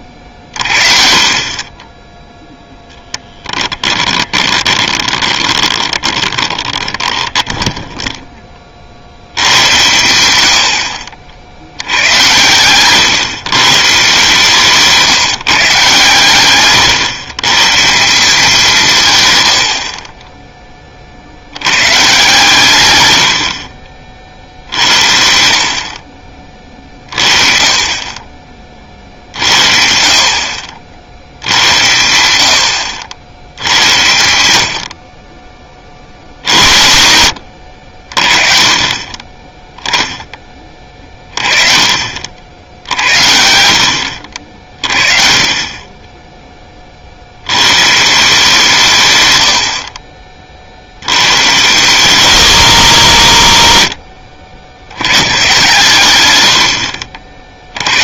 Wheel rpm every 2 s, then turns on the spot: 40, 0, 20, 20, 30, 80, 120, 150, 130, 170, 20, 130, 60, 30, 30, 70, 70, 80, 70, 20, 20, 70, 30, 20, 170, 60, 160, 90, 60.
4-8